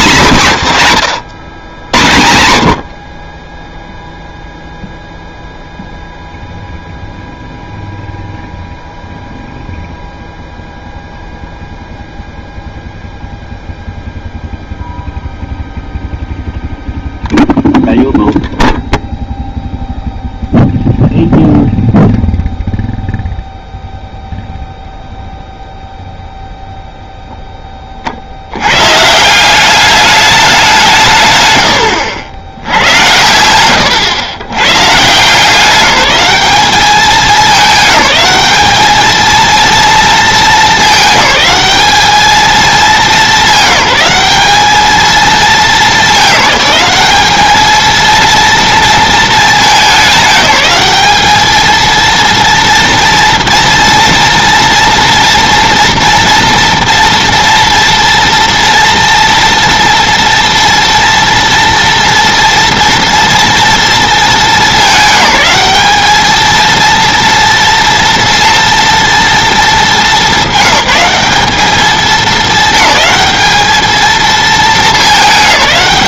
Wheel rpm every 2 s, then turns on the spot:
190, 80, 0, 0, 0, 0, 0, 0, 0, 0, 0, 0, 0, 0, 100, 190, 100, 130, 210, 210, 210, 210, 210, 200, 230, 210, 230, 230, 230, 230, 230, 230, 210, 230, 230, 210, 220, 220.
none